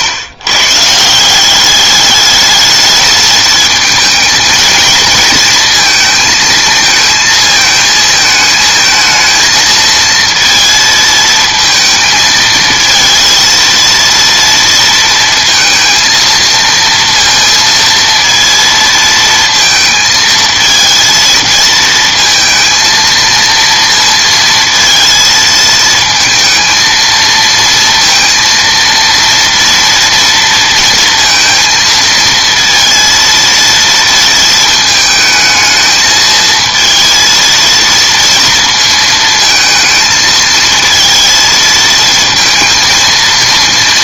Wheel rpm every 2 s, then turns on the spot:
140, 210, 220, 220, 220, 230, 220, 230, 230, 230, 230, 230, 230, 230, 230, 230, 230, 220, 220, 230, 220, 230.
none